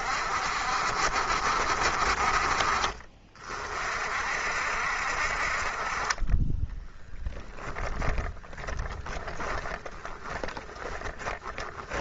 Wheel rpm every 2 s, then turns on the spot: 60, 50, 60, 30, 20, 20.
6-12